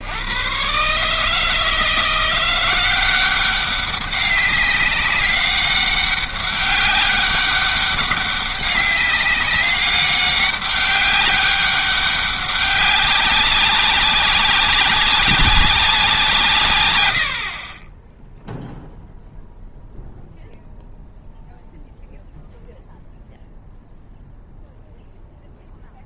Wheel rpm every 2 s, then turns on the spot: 130, 180, 200, 200, 200, 200, 200, 190, 110, 0, 0, 0, 0.
none